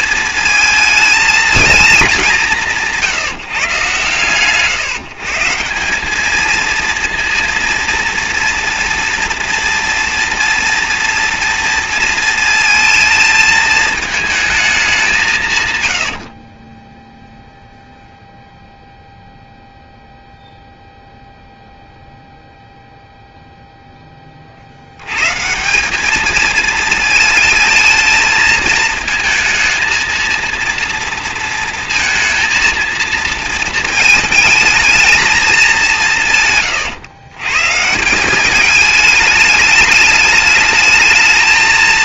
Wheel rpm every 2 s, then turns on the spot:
220, 150, 170, 230, 230, 240, 220, 160, 0, 0, 0, 0, 140, 220, 220, 230, 230, 210, 110, 210, 220.
none